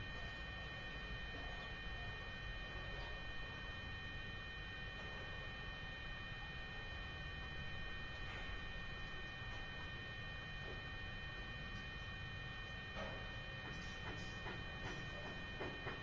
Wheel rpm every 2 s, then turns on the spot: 0, 0, 0, 0, 0, 0, 0, 0.
none